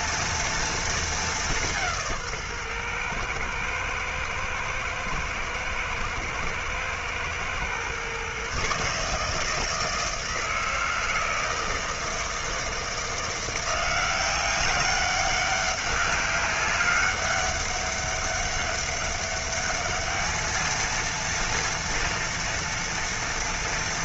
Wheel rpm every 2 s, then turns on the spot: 230, 140, 110, 110, 140, 160, 160, 190, 200, 200, 220, 230.
none